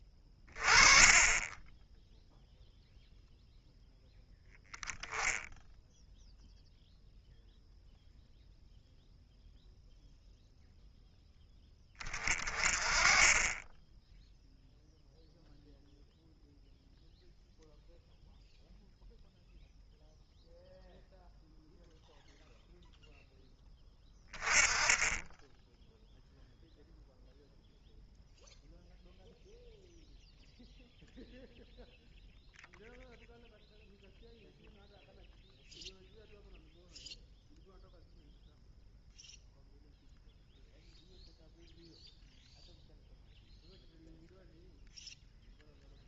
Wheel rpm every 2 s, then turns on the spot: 30, 0, 0, 0, 0, 0, 30, 0, 0, 0, 0, 0, 20, 0, 0, 0, 0, 0, 0, 0, 0, 0, 0.
none